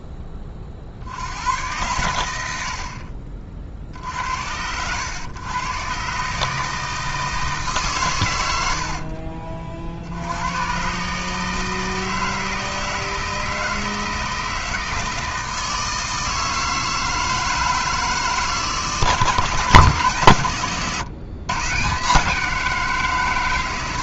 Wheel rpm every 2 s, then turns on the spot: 60, 70, 90, 160, 70, 130, 160, 160, 160, 160, 120, 150.
8-10